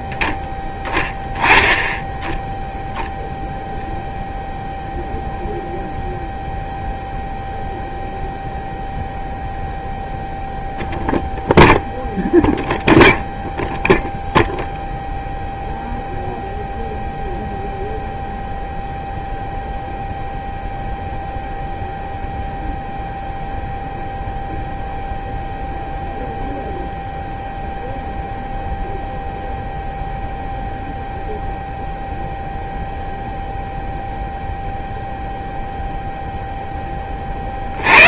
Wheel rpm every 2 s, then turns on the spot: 10, 0, 0, 0, 0, 0, 0, 0, 0, 0, 0, 0, 0, 0, 0, 0, 0, 0, 10.
none